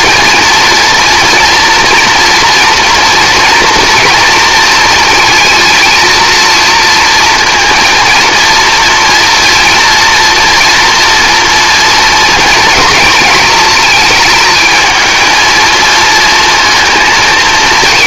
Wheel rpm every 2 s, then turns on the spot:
230, 230, 220, 230, 230, 240, 220, 220, 230.
none